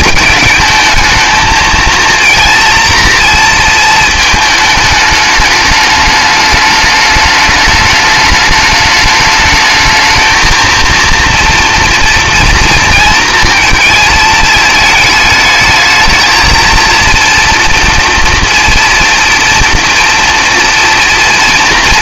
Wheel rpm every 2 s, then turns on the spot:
220, 230, 220, 210, 210, 230, 230, 220, 230, 230, 240.
none